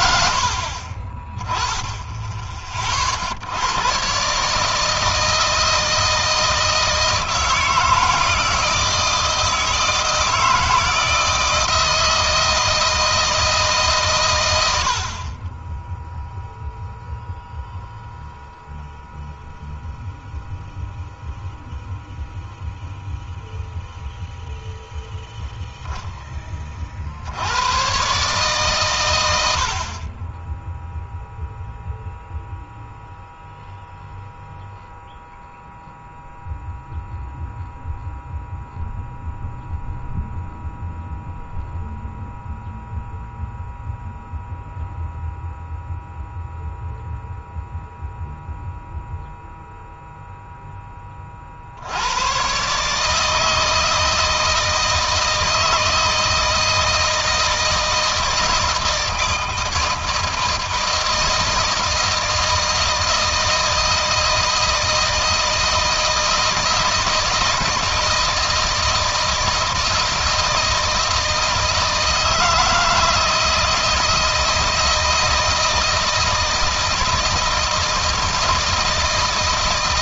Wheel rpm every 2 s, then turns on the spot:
30, 50, 160, 160, 160, 160, 160, 50, 0, 0, 0, 0, 0, 50, 120, 0, 0, 0, 0, 0, 0, 0, 0, 0, 0, 20, 150, 160, 160, 160, 160, 160, 160, 160, 160, 160, 160, 160, 160, 160.
none